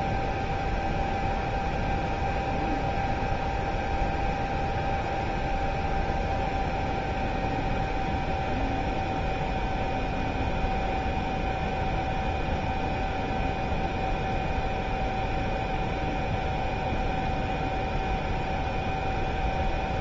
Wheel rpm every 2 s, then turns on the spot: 0, 0, 0, 0, 0, 0, 0, 0, 0, 0.
none